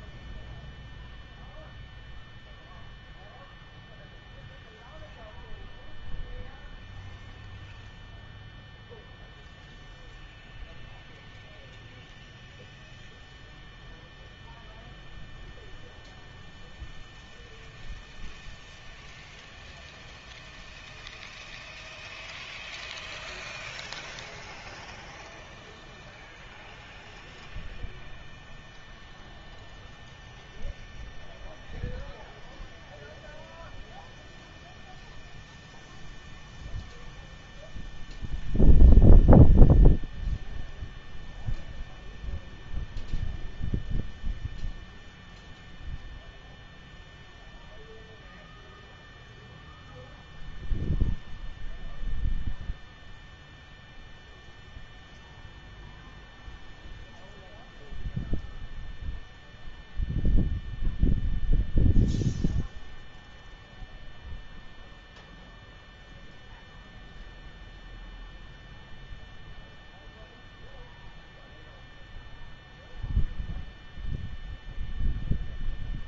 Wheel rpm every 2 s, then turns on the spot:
0, 0, 0, 0, 0, 0, 0, 0, 0, 0, 0, 0, 0, 0, 0, 0, 0, 0, 0, 0, 0, 0, 0, 0, 0, 0, 0, 0, 0, 0, 0, 0, 0, 0, 0, 0, 0, 0.
none